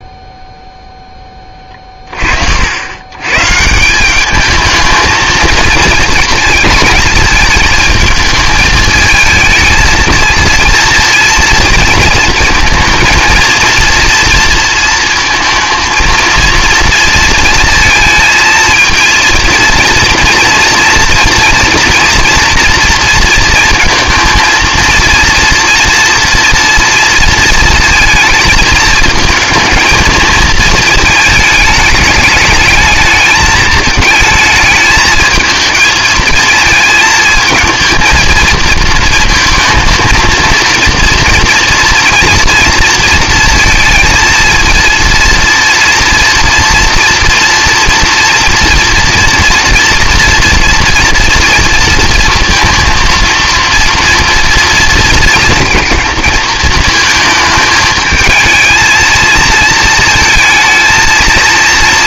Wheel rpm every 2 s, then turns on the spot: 0, 70, 220, 220, 220, 230, 230, 230, 230, 220, 230, 240, 230, 230, 220, 220, 210, 220, 220, 230, 230, 230, 230, 240, 230, 230, 230, 230, 220, 230, 220.
none